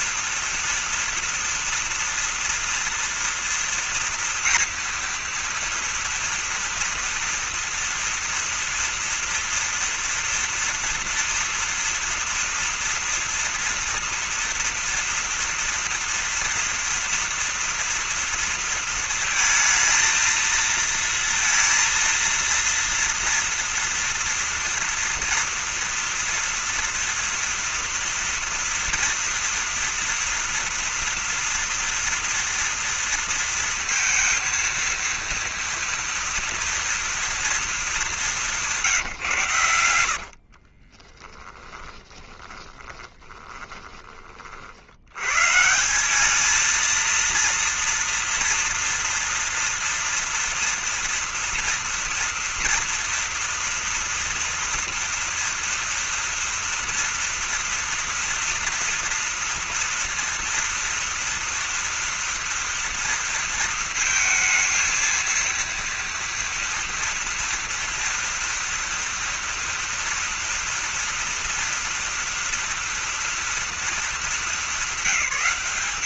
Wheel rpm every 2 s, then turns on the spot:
230, 230, 230, 230, 230, 230, 230, 230, 230, 230, 230, 230, 230, 230, 230, 230, 230, 230, 230, 200, 60, 20, 40, 220, 230, 240, 230, 230, 240, 230, 230, 230, 230, 230, 230, 230, 230, 200.
40-44